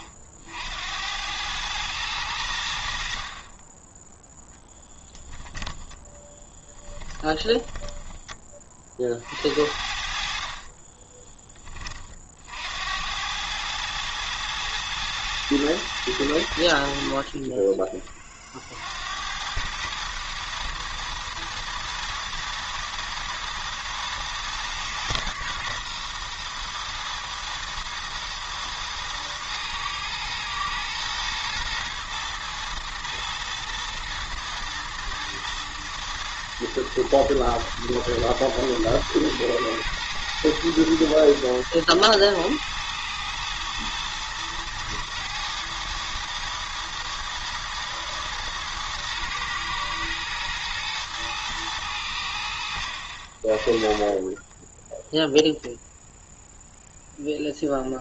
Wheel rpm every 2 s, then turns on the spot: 70, 80, 10, 10, 30, 40, 70, 110, 70, 60, 110, 110, 110, 120, 110, 120, 110, 110, 110, 110, 110, 110, 120, 110, 110, 120, 70, 10, 0.
6-8 10-12 54-56